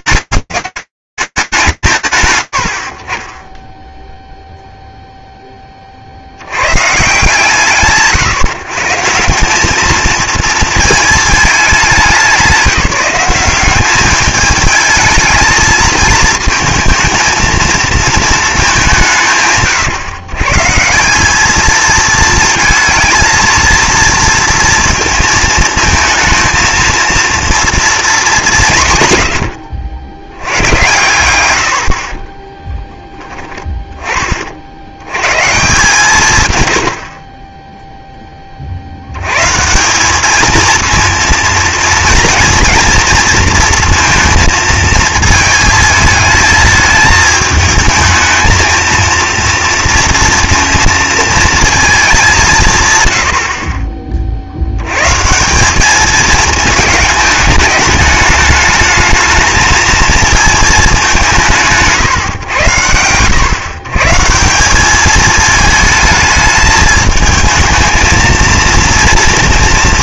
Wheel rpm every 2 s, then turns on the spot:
200, 80, 0, 140, 150, 220, 190, 220, 220, 190, 170, 230, 230, 230, 140, 110, 10, 100, 60, 120, 230, 230, 220, 220, 230, 230, 80, 160, 210, 220, 190, 120, 220, 220, 230.
none